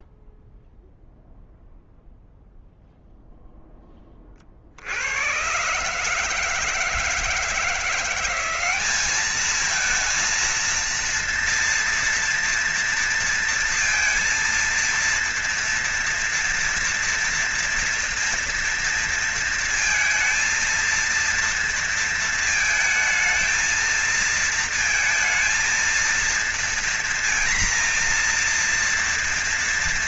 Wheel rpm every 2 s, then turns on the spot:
0, 0, 50, 160, 190, 230, 230, 230, 230, 230, 230, 230, 220, 230, 230.
none